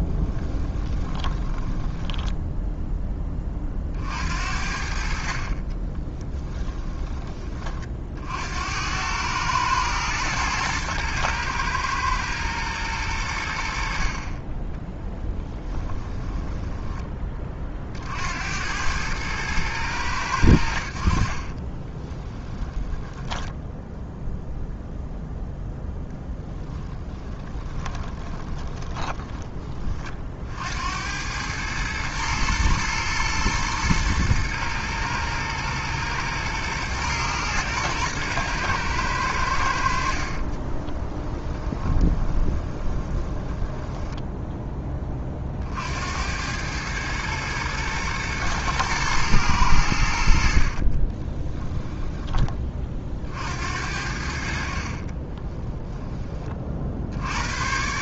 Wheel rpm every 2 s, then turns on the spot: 20, 10, 60, 10, 80, 110, 110, 30, 10, 90, 70, 10, 0, 10, 20, 70, 110, 110, 110, 110, 30, 20, 10, 100, 120, 50, 30, 70, 50.
0-2 6-8 16-18 22-24 26-30 40-44 50-52